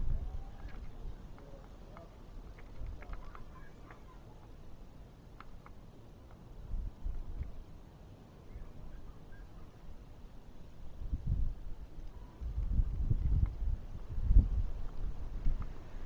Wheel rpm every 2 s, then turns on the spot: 0, 0, 0, 0, 0, 0, 0, 0.
none